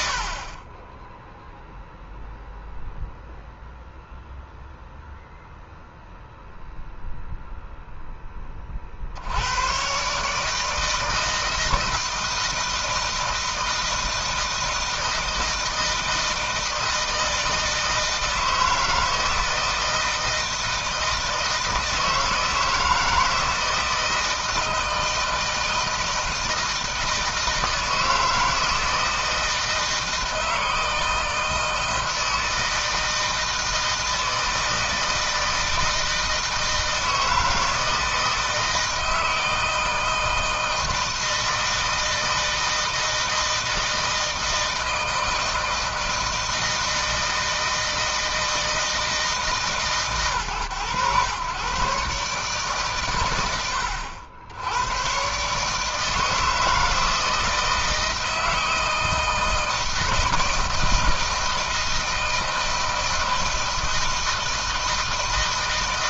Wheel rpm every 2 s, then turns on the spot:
30, 0, 0, 0, 30, 150, 170, 160, 160, 160, 160, 160, 160, 160, 160, 160, 160, 160, 160, 160, 160, 160, 160, 160, 160, 120, 130, 90, 160, 160, 160, 160, 160.
none